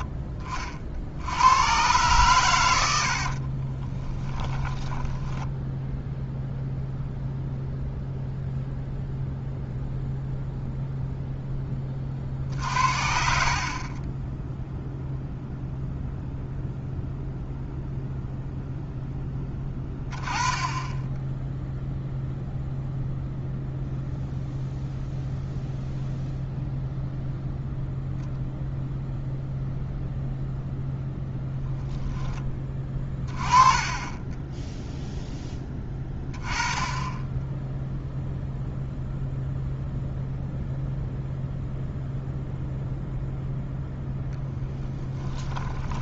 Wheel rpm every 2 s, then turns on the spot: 40, 90, 10, 0, 0, 0, 60, 0, 0, 0, 20, 0, 0, 0, 0, 0, 20, 0, 10, 0, 0, 0, 10.
2-6 12-14 44-46